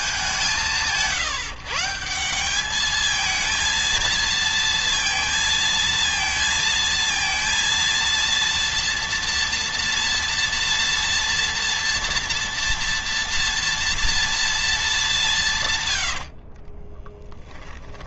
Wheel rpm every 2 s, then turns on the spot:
160, 220, 230, 230, 230, 230, 230, 200, 20.
16-18